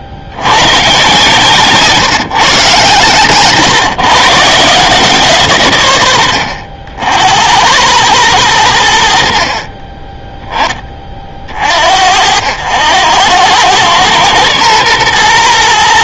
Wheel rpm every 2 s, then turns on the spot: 90, 140, 160, 80, 90, 20, 80, 120.
none